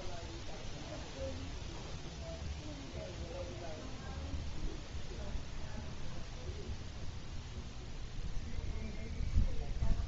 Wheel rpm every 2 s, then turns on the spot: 0, 0, 0, 0, 0.
none